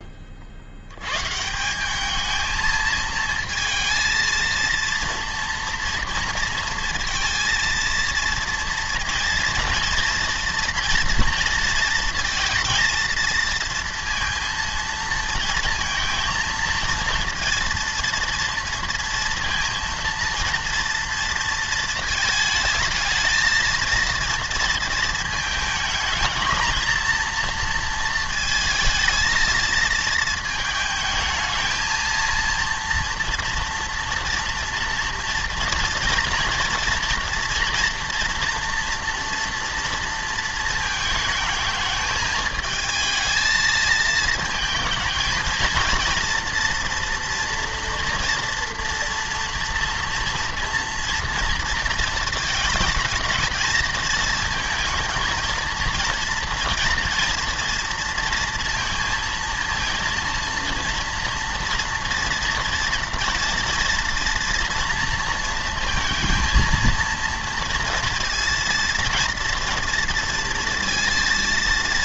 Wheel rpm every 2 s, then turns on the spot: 60, 220, 230, 230, 230, 230, 230, 230, 230, 230, 230, 220, 230, 220, 220, 220, 230, 230, 230, 230, 220, 220, 220, 230, 230, 230, 220, 220, 230, 230, 230, 240, 230, 230, 230, 230.
none